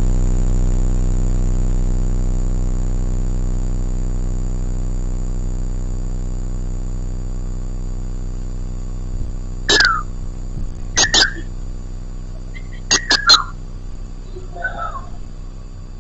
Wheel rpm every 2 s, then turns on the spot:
0, 0, 0, 0, 0, 0, 0, 0.
none